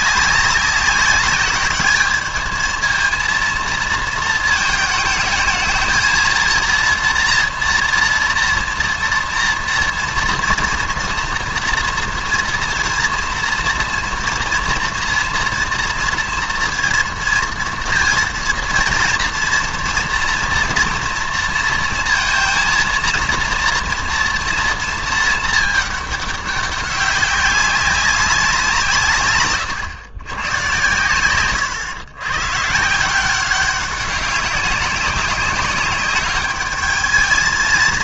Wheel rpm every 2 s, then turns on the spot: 200, 220, 220, 230, 230, 230, 230, 230, 230, 230, 230, 230, 230, 200, 180, 110, 150, 190, 210.
none